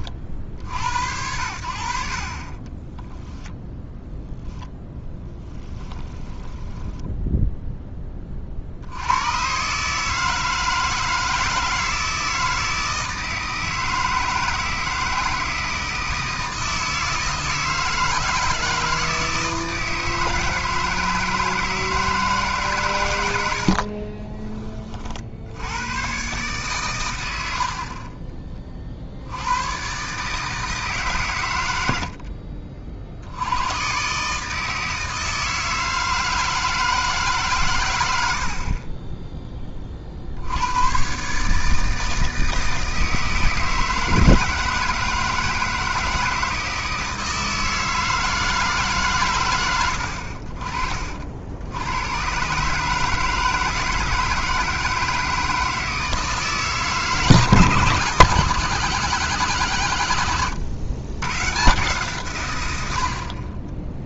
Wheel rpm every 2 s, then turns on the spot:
80, 10, 10, 10, 70, 160, 160, 160, 160, 160, 160, 130, 40, 110, 50, 150, 50, 160, 160, 30, 110, 160, 160, 160, 140, 50, 150, 160, 140, 170, 110, 80.
2-8